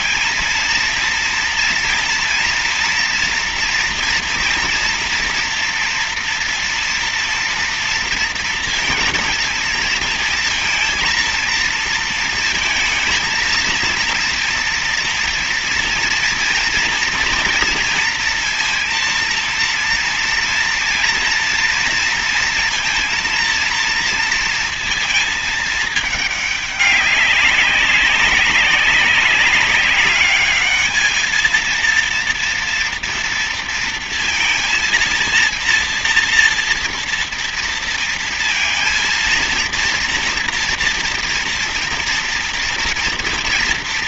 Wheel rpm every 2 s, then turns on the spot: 220, 230, 230, 240, 230, 230, 230, 230, 240, 230, 230, 230, 230, 210, 190, 210, 240, 230, 230, 230, 230, 230.
none